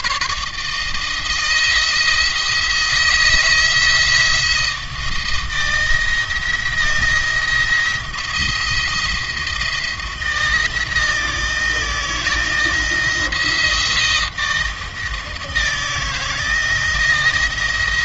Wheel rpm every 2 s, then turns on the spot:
150, 160, 170, 170, 170, 170, 170, 160, 160.
none